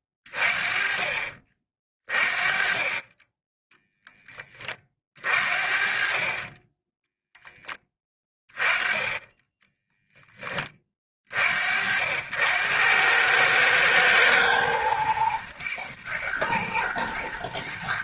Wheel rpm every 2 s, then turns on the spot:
40, 30, 30, 20, 20, 30, 90, 110, 120.
none